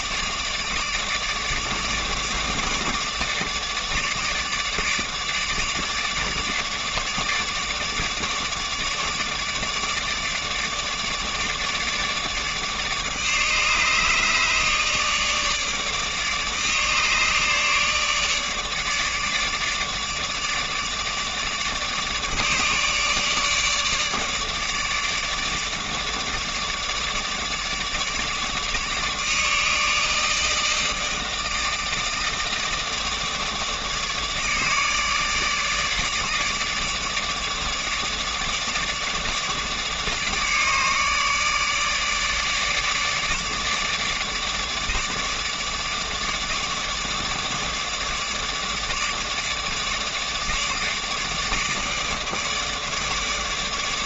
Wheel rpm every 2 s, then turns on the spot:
150, 160, 150, 150, 150, 150, 150, 150, 150, 150, 150, 150, 150, 160, 150, 160, 150, 150, 150, 150, 150, 150, 150, 150, 150, 160, 150.
none